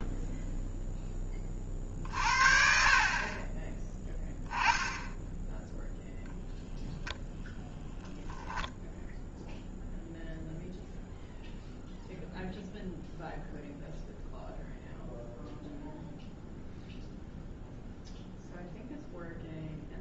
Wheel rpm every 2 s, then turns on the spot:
0, 40, 10, 0, 10, 0, 0, 0, 0, 0.
none